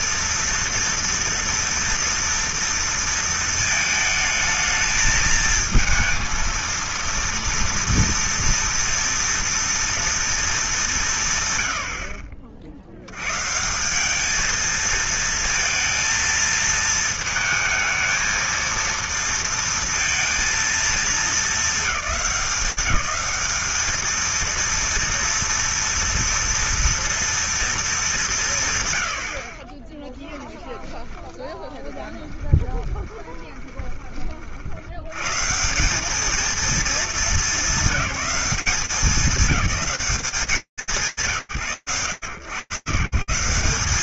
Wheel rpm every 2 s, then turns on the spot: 230, 230, 220, 230, 230, 230, 60, 210, 230, 230, 230, 200, 230, 230, 160, 10, 20, 40, 210, 190, 150, 110.
30-34